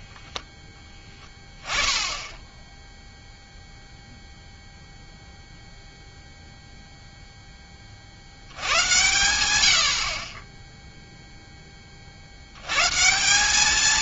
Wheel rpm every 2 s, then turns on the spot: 10, 10, 0, 0, 80, 10, 110.
none